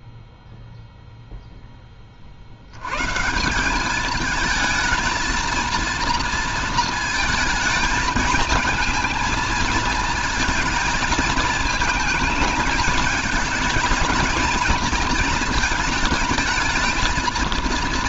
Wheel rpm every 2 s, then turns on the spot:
0, 110, 220, 230, 220, 220, 220, 230, 220.
none